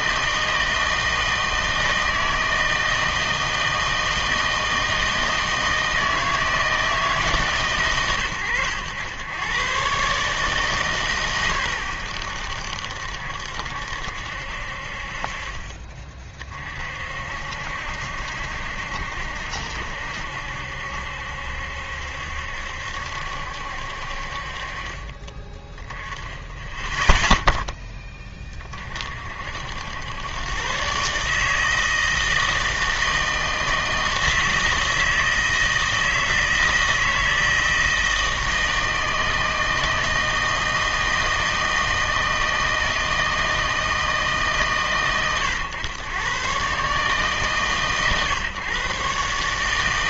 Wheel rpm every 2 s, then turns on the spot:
160, 160, 160, 160, 100, 140, 70, 50, 50, 70, 70, 70, 40, 0, 40, 140, 160, 160, 160, 160, 160, 160, 130, 140, 130.
none